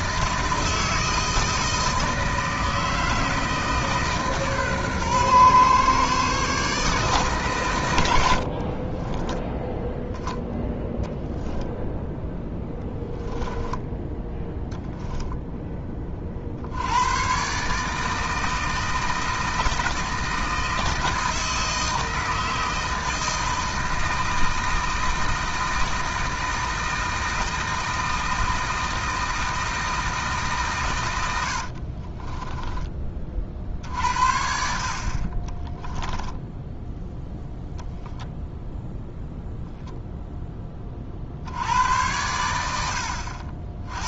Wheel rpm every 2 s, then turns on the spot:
160, 160, 130, 150, 30, 10, 10, 0, 90, 160, 160, 160, 160, 160, 160, 130, 20, 50, 0, 0, 20, 80.
8-10 12-14